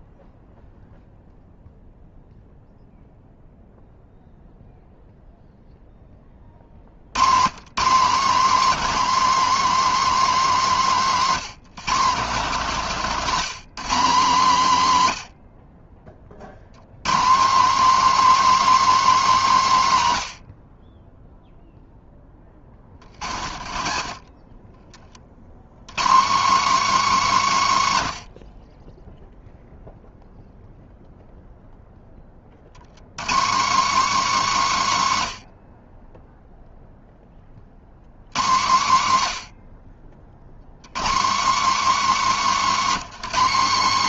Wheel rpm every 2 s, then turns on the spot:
0, 0, 0, 60, 250, 220, 190, 170, 100, 300, 60, 30, 30, 260, 50, 0, 80, 240, 0, 140, 120, 260.
none